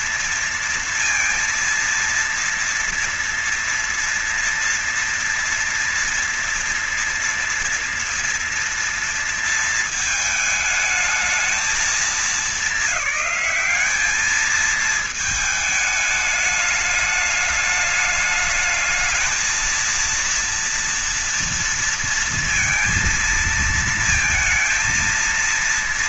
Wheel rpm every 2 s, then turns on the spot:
230, 230, 230, 240, 230, 210, 190, 220, 210, 220, 230, 230, 230.
none